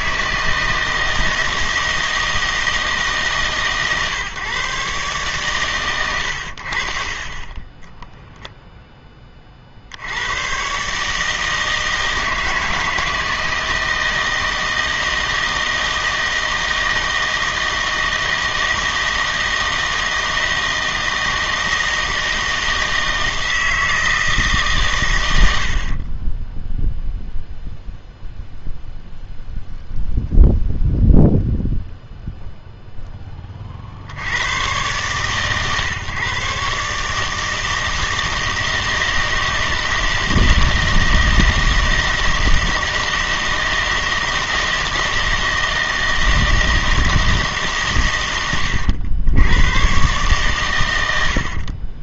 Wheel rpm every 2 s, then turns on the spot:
160, 160, 140, 60, 0, 130, 160, 160, 160, 160, 160, 160, 140, 0, 0, 0, 0, 110, 140, 160, 160, 160, 160, 160, 100, 120.
none